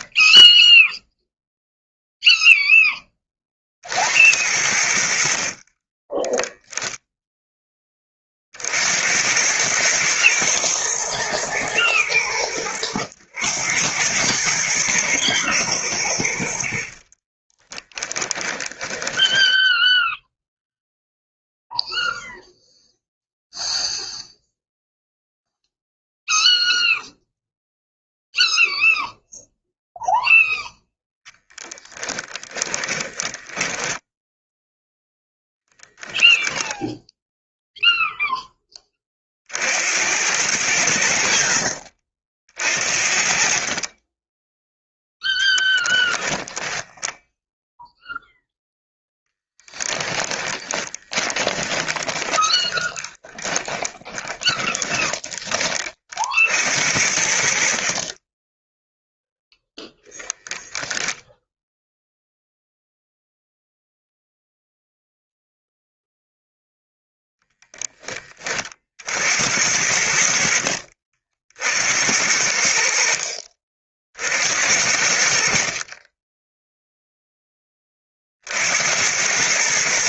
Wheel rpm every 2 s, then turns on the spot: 0, 0, 70, 0, 60, 110, 100, 110, 70, 20, 0, 0, 0, 0, 0, 10, 20, 0, 0, 20, 90, 50, 0, 10, 0, 20, 30, 20, 70, 10, 0, 0, 0, 0, 40, 60, 70, 70, 0, 70.
16-20 30-34 46-48 50-56